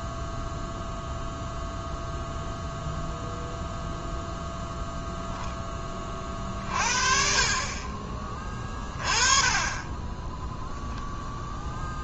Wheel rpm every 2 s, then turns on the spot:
0, 0, 0, 40, 20, 0.
none